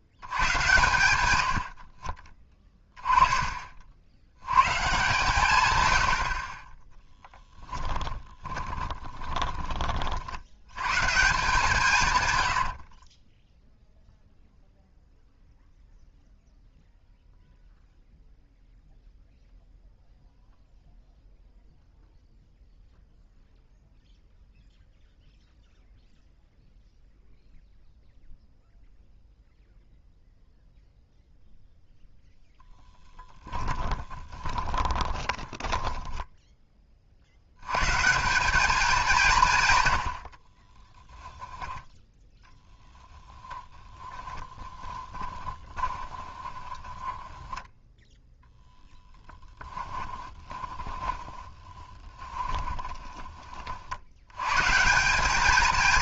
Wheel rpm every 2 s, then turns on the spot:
110, 10, 130, 30, 20, 80, 90, 0, 0, 0, 0, 0, 0, 0, 0, 0, 10, 20, 10, 190, 40, 10, 10, 20, 0, 20, 20, 140.
8-10 12-14 34-36 40-42 44-48 50-54